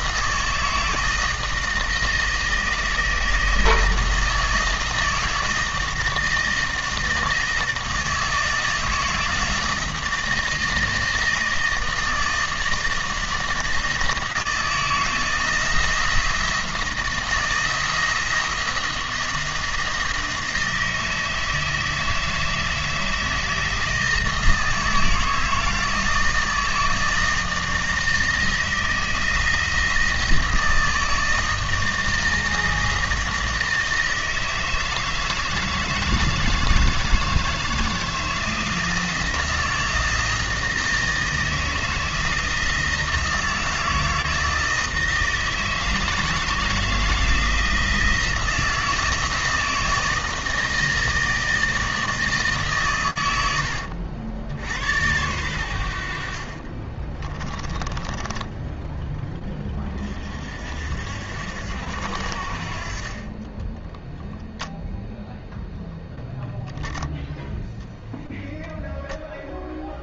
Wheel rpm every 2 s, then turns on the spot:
160, 160, 160, 160, 160, 160, 160, 160, 170, 170, 160, 160, 160, 160, 160, 160, 160, 160, 160, 170, 160, 160, 160, 160, 170, 160, 130, 90, 30, 10, 60, 50, 0, 0, 0.
56-58